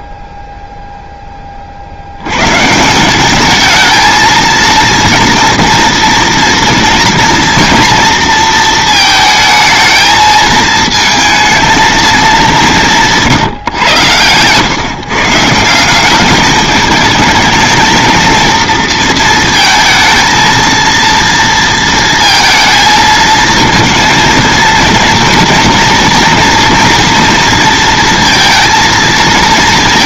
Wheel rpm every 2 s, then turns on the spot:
0, 150, 230, 230, 230, 220, 190, 130, 210, 230, 230, 230, 230, 230, 230.
none